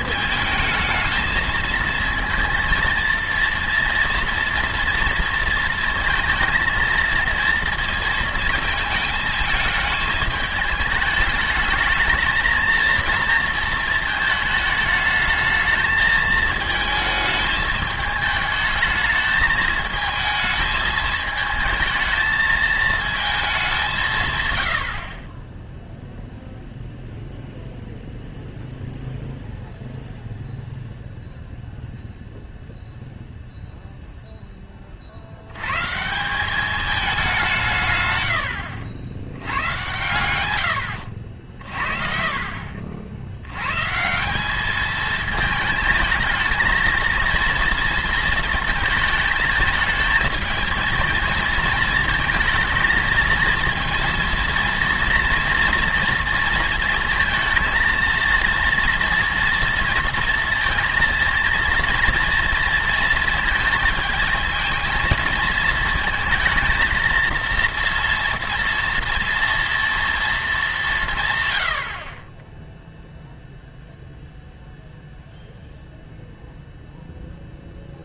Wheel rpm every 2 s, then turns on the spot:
220, 230, 230, 230, 220, 220, 230, 220, 220, 220, 220, 220, 100, 0, 0, 0, 0, 20, 200, 80, 90, 50, 200, 220, 220, 220, 220, 230, 230, 230, 230, 230, 230, 230, 230, 210, 10, 0, 0.
none